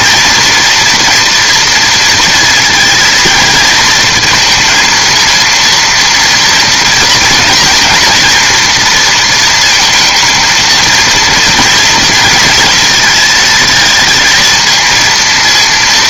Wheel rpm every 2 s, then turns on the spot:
240, 230, 230, 230, 230, 230, 220, 230.
none